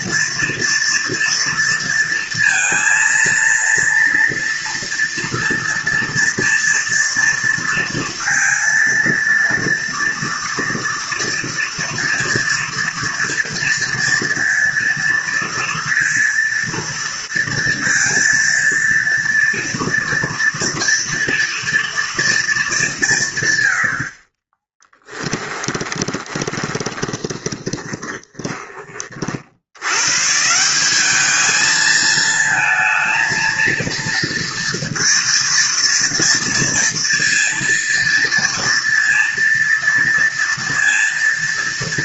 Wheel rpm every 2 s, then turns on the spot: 230, 230, 230, 230, 230, 230, 230, 230, 230, 230, 230, 180, 10, 20, 40, 190, 230, 230, 230, 240, 230.
24-28